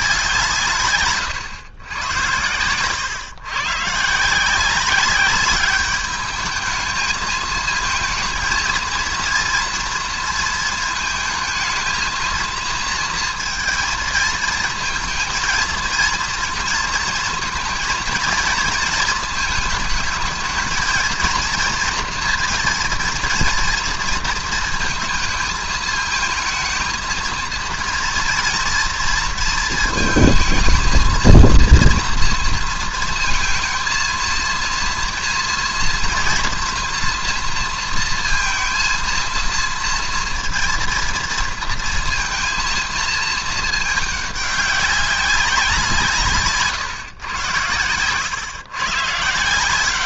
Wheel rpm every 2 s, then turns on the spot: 150, 110, 180, 220, 230, 220, 220, 220, 230, 220, 220, 230, 230, 220, 230, 220, 230, 230, 230, 230, 230, 230, 200, 150, 130.
none